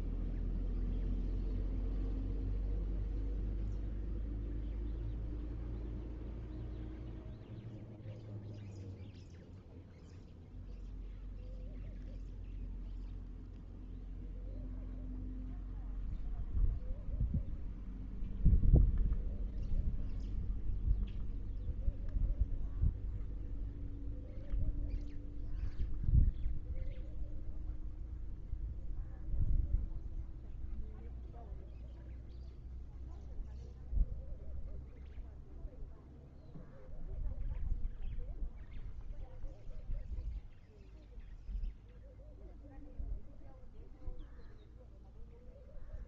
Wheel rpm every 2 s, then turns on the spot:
0, 0, 0, 0, 0, 0, 0, 0, 0, 0, 0, 0, 0, 0, 0, 0, 0, 0, 0, 0, 0, 0, 0.
none